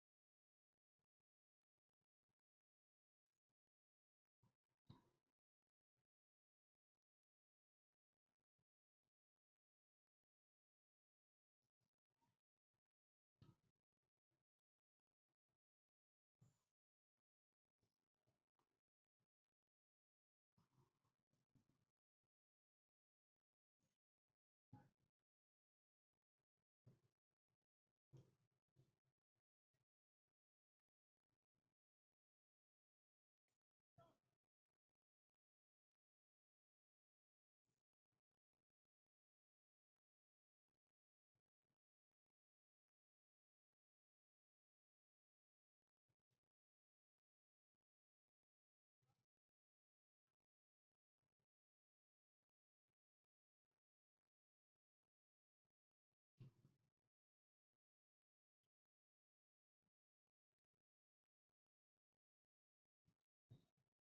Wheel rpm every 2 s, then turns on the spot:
0, 0, 0, 0, 0, 0, 0, 0, 0, 0, 0, 0, 0, 0, 0, 0, 0, 0, 0, 0, 0, 0, 0, 0, 0, 0, 0, 0, 0, 0, 0, 0.
none